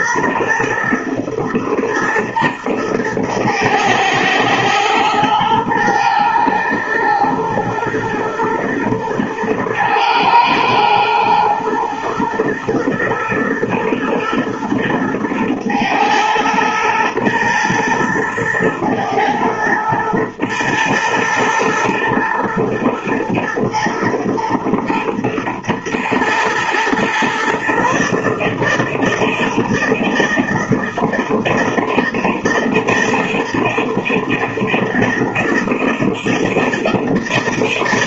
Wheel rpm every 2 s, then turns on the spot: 120, 110, 120, 120, 110, 110, 110, 110, 120, 110, 110, 110, 120, 120, 160, 160, 160, 160, 160.
none